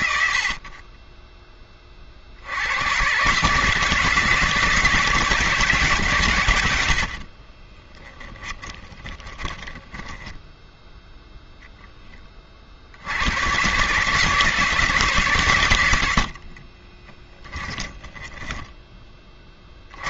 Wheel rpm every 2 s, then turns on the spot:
40, 90, 170, 90, 20, 20, 60, 160, 40, 20.
8-12 16-20